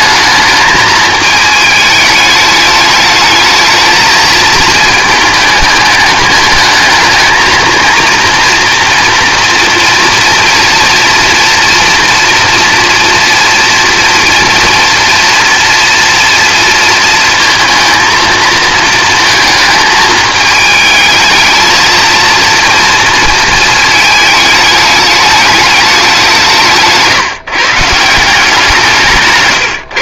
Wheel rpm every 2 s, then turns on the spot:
220, 210, 220, 220, 230, 230, 240, 230, 230, 220, 220, 230, 210, 170, 170.
none